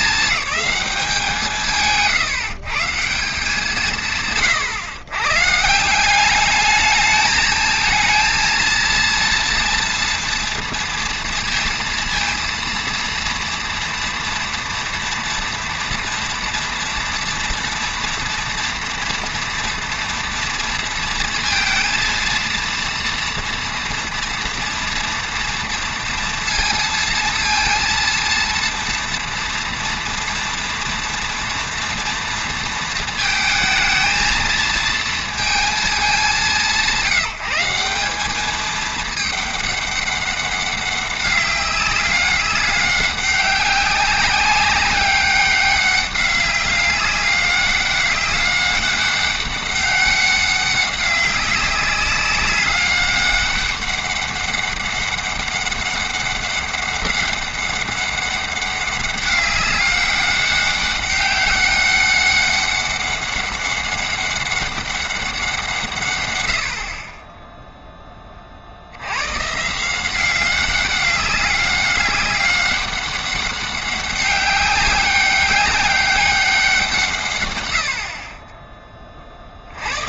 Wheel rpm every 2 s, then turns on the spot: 220, 150, 120, 210, 230, 230, 230, 230, 230, 230, 230, 230, 230, 230, 230, 240, 230, 230, 170, 210, 200, 200, 190, 200, 200, 190, 200, 200, 200, 200, 200, 200, 200, 60, 50, 190, 200, 200, 180, 20.
none